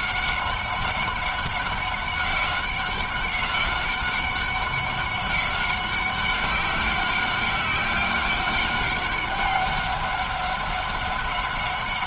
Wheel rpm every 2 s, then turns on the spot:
200, 190, 190, 190, 190, 190.
none